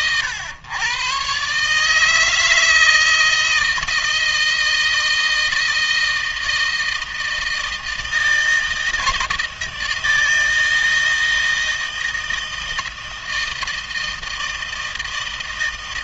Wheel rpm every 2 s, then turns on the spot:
120, 160, 160, 160, 160, 160, 160, 160.
none